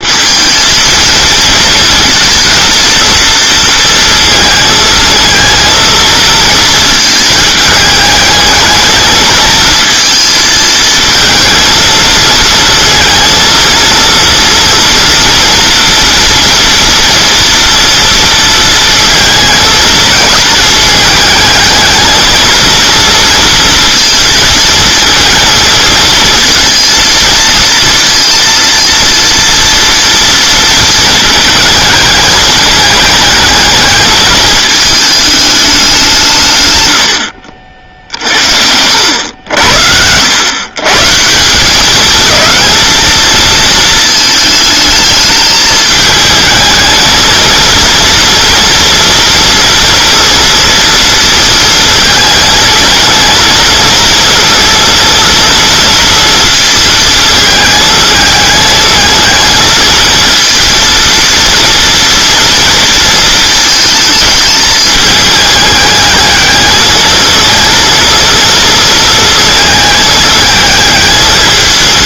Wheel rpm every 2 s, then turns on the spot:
230, 230, 220, 220, 220, 230, 230, 240, 240, 230, 210, 230, 230, 230, 230, 230, 220, 220, 110, 80, 130, 220, 220, 220, 230, 230, 230, 230, 230, 220, 230, 230, 210, 220, 230, 220.
none